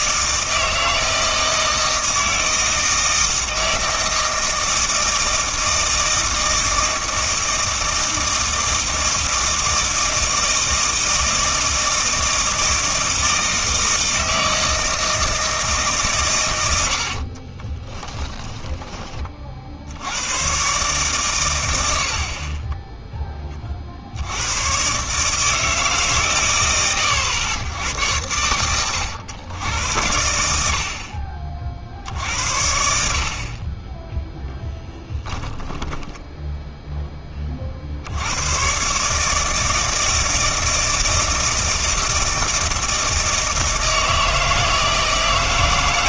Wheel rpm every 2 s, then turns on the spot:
160, 160, 160, 160, 160, 160, 160, 160, 80, 30, 130, 20, 120, 110, 110, 70, 70, 20, 10, 120, 160, 160, 160.
18-20 34-36